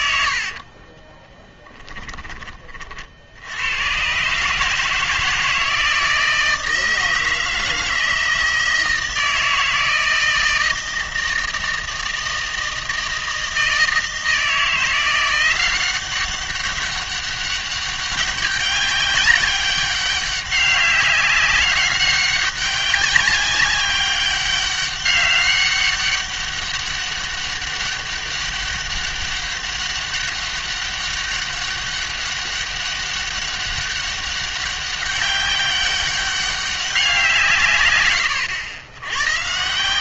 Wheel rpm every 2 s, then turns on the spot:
60, 30, 150, 160, 160, 160, 160, 170, 190, 200, 200, 200, 200, 200, 200, 200, 200, 200, 200, 100.
0-2